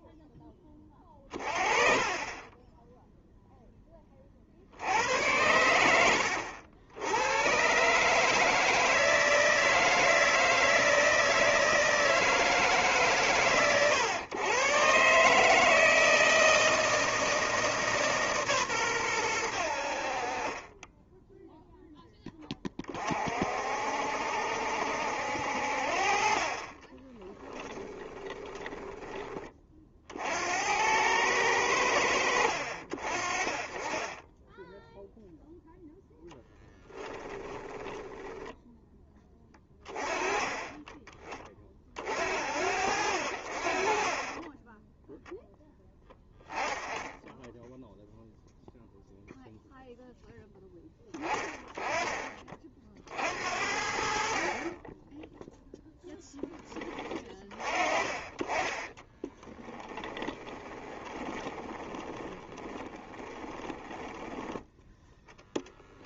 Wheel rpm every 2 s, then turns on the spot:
20, 10, 90, 80, 160, 160, 150, 130, 160, 120, 20, 30, 70, 30, 20, 90, 40, 0, 10, 10, 20, 60, 10, 10, 0, 10, 40, 30, 10, 20, 20, 30, 10.
20-22 26-30 36-38 60-66